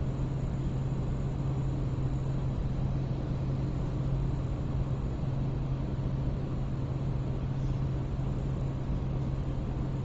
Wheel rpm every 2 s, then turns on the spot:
0, 0, 0, 0, 0.
none